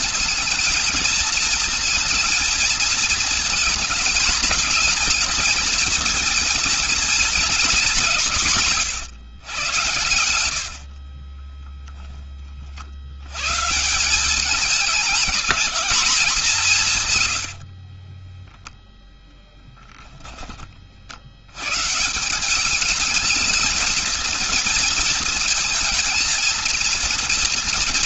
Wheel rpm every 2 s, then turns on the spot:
220, 230, 220, 230, 150, 50, 70, 210, 180, 10, 40, 210, 230, 230.
10-12